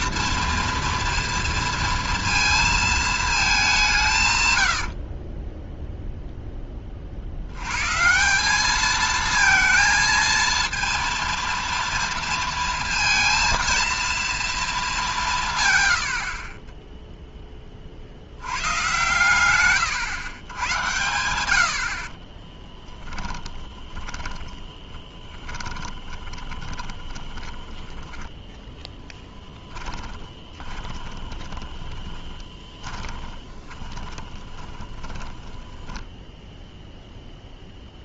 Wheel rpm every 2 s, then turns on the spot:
230, 220, 90, 20, 210, 230, 230, 220, 20, 110, 110, 20, 10, 20, 10, 20, 20, 20, 0.
4-6 22-28 30-36